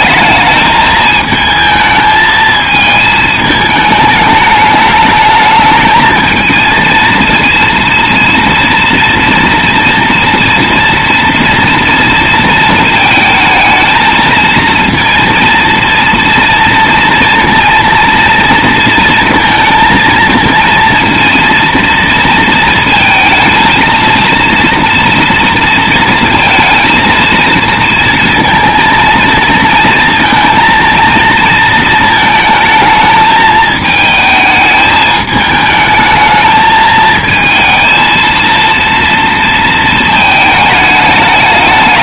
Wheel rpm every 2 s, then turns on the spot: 220, 220, 210, 220, 230, 240, 230, 230, 230, 230, 230, 230, 230, 230, 230, 230, 220, 220, 220, 230, 220.
none